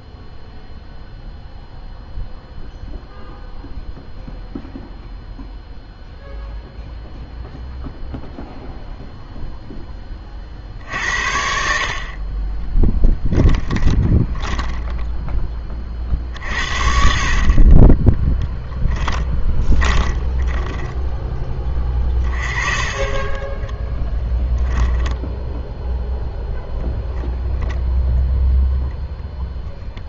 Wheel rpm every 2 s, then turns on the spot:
0, 0, 0, 0, 0, 60, 20, 10, 60, 10, 20, 20, 10, 0, 0.
12-26